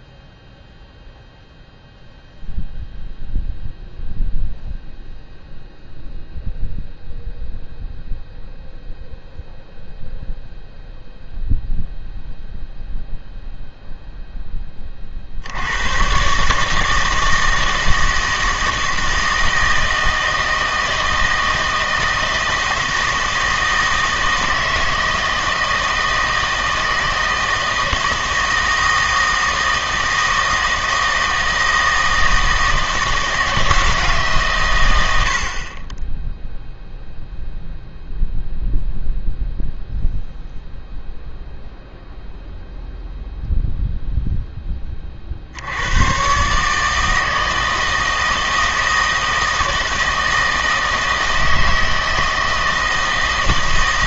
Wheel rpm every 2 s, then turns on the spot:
0, 0, 0, 0, 0, 0, 0, 10, 150, 160, 160, 160, 160, 160, 160, 160, 160, 130, 0, 0, 0, 0, 10, 140, 160, 160, 160.
none